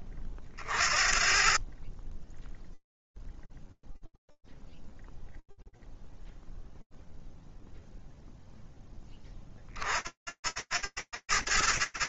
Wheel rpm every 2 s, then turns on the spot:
10, 0, 0, 0, 70, 30.
none